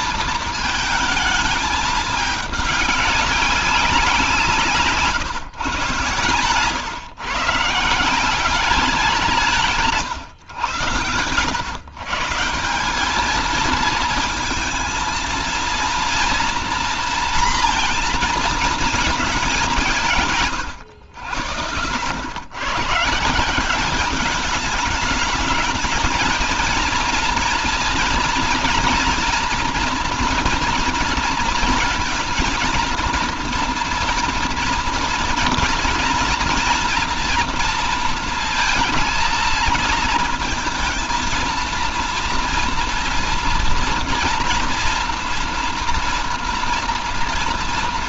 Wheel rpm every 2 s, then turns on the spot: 220, 200, 160, 140, 190, 120, 180, 230, 230, 220, 120, 120, 210, 230, 230, 240, 230, 230, 230, 230, 230, 230, 240, 230.
none